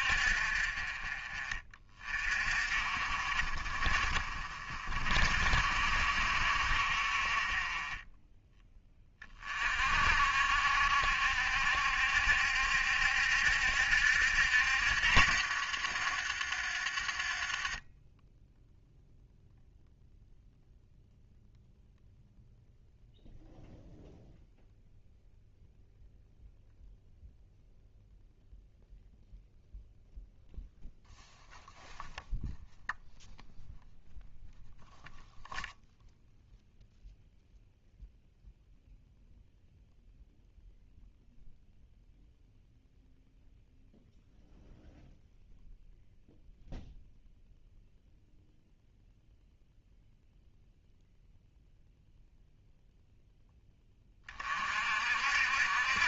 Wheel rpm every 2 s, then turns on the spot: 40, 50, 40, 60, 10, 60, 70, 70, 40, 0, 0, 0, 0, 0, 0, 0, 0, 0, 0, 0, 0, 0, 0, 0, 0, 0, 0, 50.
none